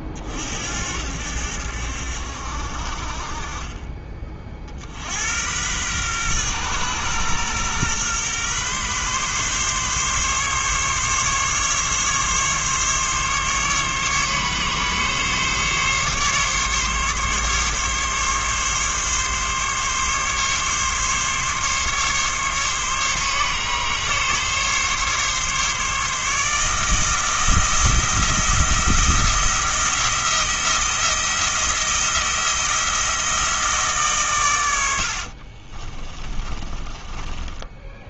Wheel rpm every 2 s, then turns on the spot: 70, 50, 50, 120, 130, 140, 140, 140, 140, 140, 140, 140, 140, 160, 170, 170, 170, 100, 30.
36-38